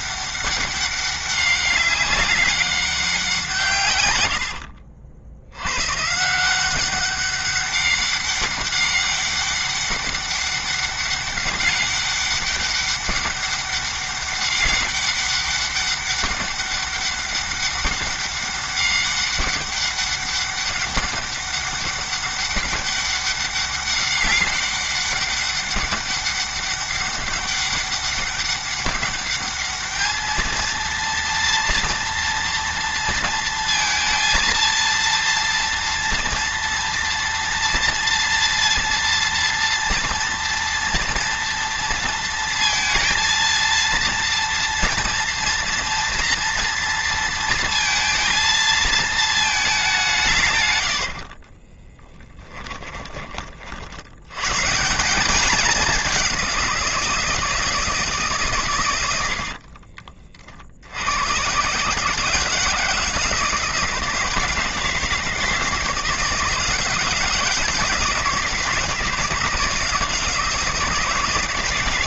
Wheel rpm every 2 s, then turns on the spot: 200, 190, 70, 180, 200, 200, 200, 200, 200, 200, 200, 200, 200, 200, 200, 230, 230, 230, 230, 230, 240, 230, 230, 230, 230, 90, 10, 150, 180, 120, 60, 160, 160, 160, 160, 160.
4-6 50-52